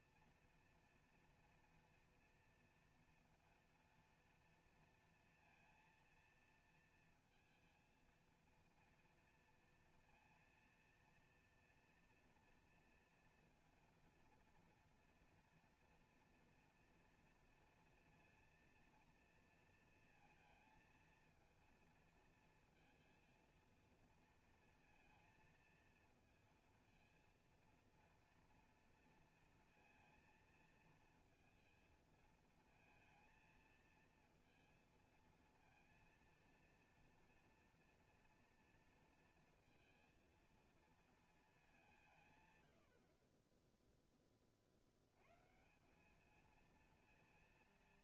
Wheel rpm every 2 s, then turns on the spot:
240, 230, 230, 230, 230, 230, 230, 230, 240, 230, 230, 230, 230, 230, 230, 230, 230, 230, 230, 230, 230, 90, 40, 220.
none